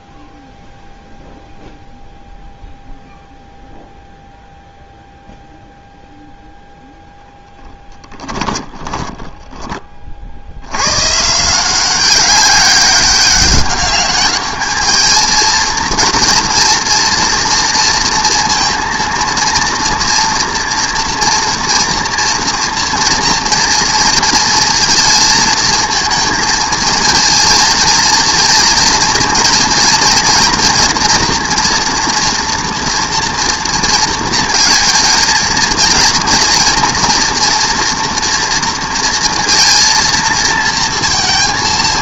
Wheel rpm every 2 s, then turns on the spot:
0, 0, 0, 20, 90, 200, 210, 230, 230, 230, 230, 230, 220, 230, 240, 230, 220, 230, 230, 230, 40.
6-8